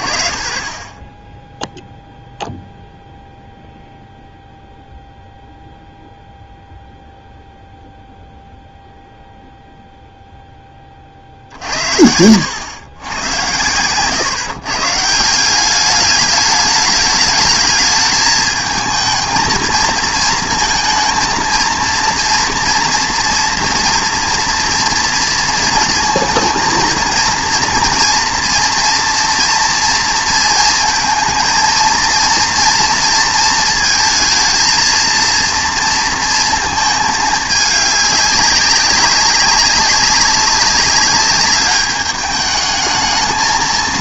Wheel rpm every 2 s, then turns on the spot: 40, 0, 0, 0, 0, 20, 100, 140, 210, 220, 220, 230, 230, 230, 230, 230, 240, 230, 220, 200, 200, 220.
none